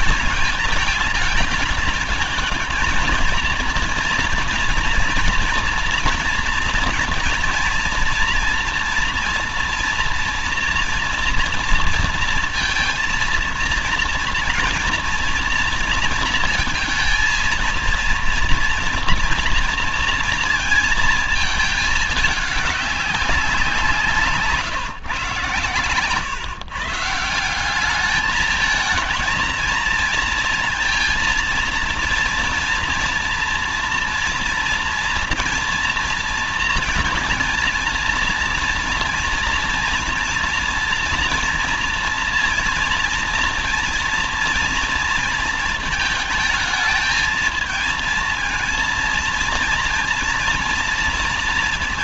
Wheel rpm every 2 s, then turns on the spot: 220, 220, 230, 230, 230, 240, 230, 230, 230, 230, 230, 210, 160, 140, 220, 230, 230, 240, 240, 230, 230, 230, 230, 220, 230, 230.
none